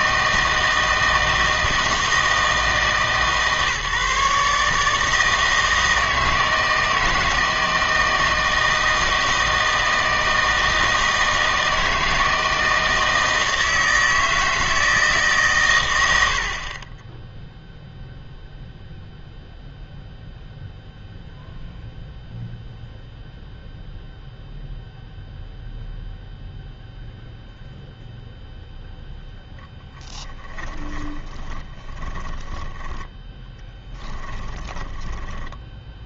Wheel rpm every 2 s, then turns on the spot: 160, 160, 160, 160, 160, 160, 160, 160, 30, 0, 0, 0, 0, 0, 0, 20, 10, 10.
30-36